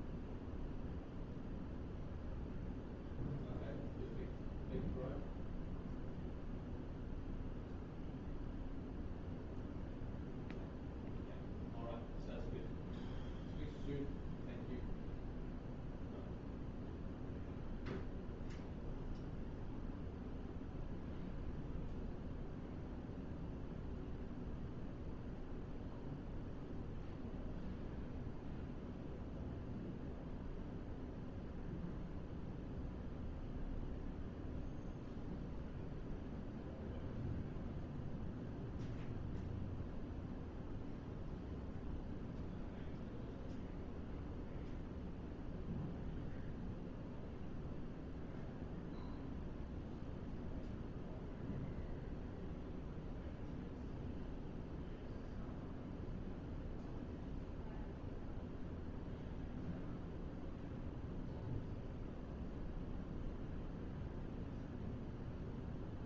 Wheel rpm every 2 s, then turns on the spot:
0, 0, 0, 0, 0, 0, 0, 0, 0, 0, 0, 0, 0, 0, 0, 0, 0, 0, 0, 0, 0, 0, 0, 0, 0, 0, 0, 0, 0, 0, 0, 0, 0.
none